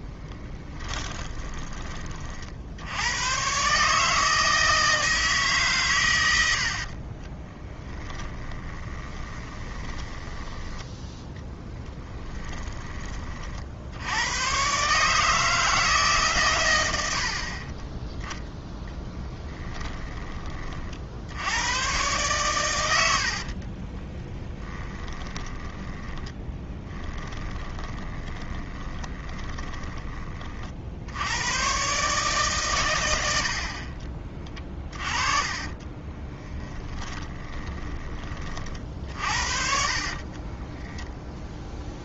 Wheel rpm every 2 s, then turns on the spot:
20, 80, 160, 60, 20, 10, 20, 130, 100, 10, 50, 90, 20, 20, 30, 60, 120, 30, 20, 40, 20.
0-2 6-10 18-20 24-30 34-38 40-42